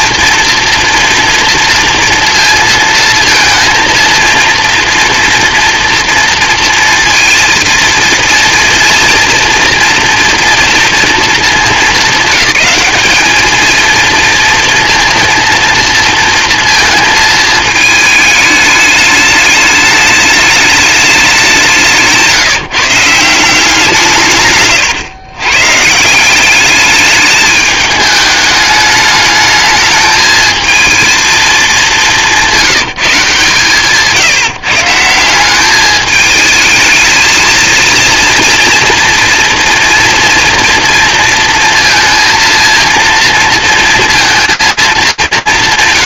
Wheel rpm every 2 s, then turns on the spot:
230, 230, 230, 230, 230, 230, 210, 220, 230, 220, 210, 170, 160, 170, 210, 220, 210, 160, 210, 230, 230, 230, 230.
none